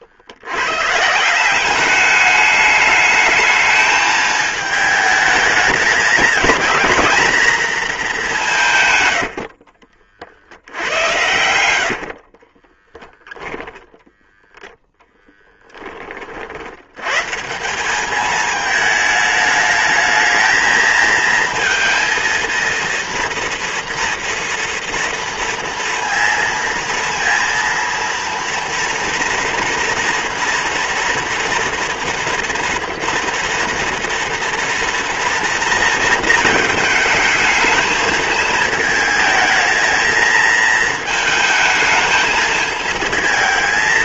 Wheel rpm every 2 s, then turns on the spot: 140, 210, 210, 220, 120, 80, 10, 10, 110, 220, 220, 230, 230, 230, 230, 230, 230, 230, 220, 220, 220, 220.
8-16